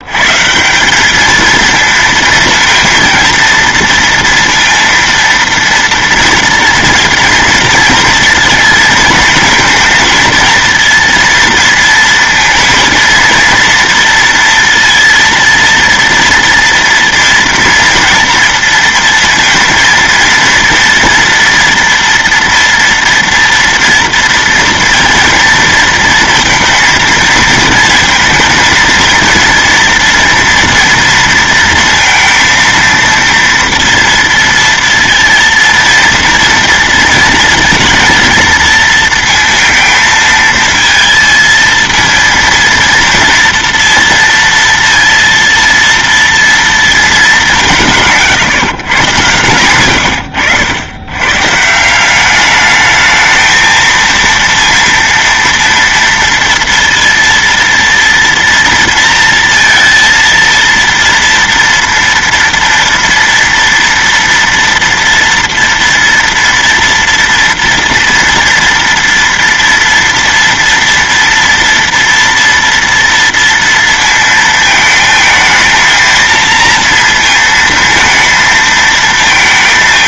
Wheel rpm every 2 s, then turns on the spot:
190, 230, 230, 230, 230, 230, 230, 230, 230, 230, 230, 230, 240, 230, 230, 230, 230, 230, 230, 230, 220, 230, 230, 220, 130, 100, 220, 230, 230, 230, 230, 230, 230, 230, 230, 230, 230, 220, 230, 230.
none